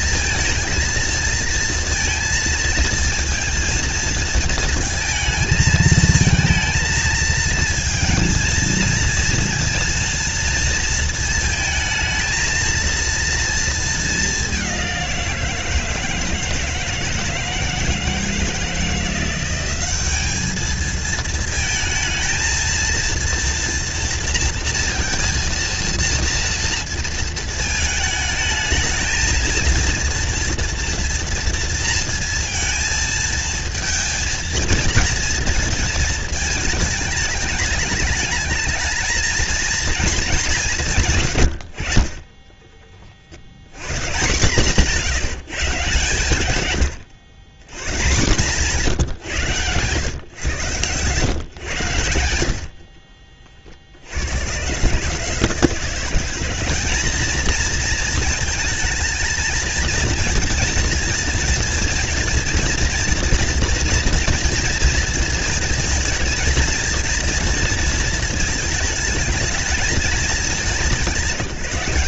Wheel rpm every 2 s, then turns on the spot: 230, 230, 220, 230, 230, 230, 220, 200, 160, 160, 210, 230, 230, 230, 220, 230, 230, 230, 210, 220, 190, 20, 160, 120, 150, 120, 70, 130, 210, 230, 230, 240, 240, 230, 220, 200.
42-44 52-54